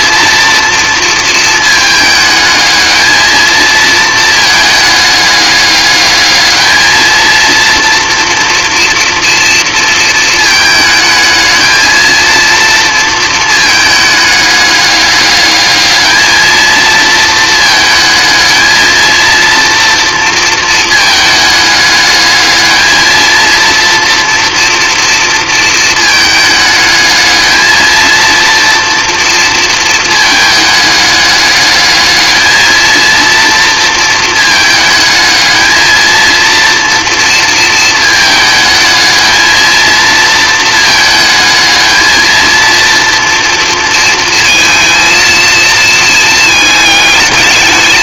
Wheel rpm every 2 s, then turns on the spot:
230, 220, 220, 220, 230, 220, 230, 210, 220, 220, 230, 220, 230, 220, 230, 210, 220, 220, 230, 220, 220, 230, 230, 220.
none